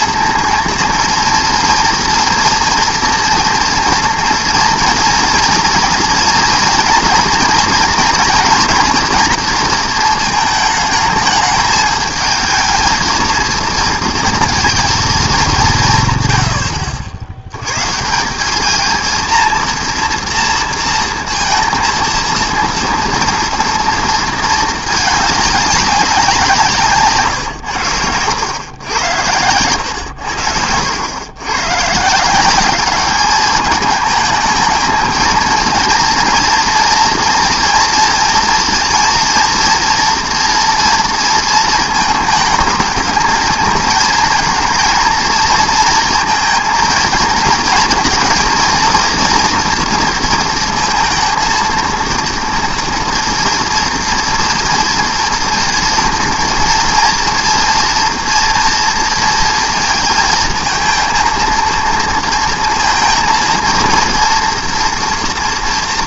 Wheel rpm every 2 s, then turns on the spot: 230, 230, 230, 230, 230, 220, 230, 230, 80, 210, 230, 230, 220, 160, 100, 80, 200, 220, 230, 230, 230, 220, 230, 230, 230, 230, 230, 230, 230, 230, 230, 230, 230.
none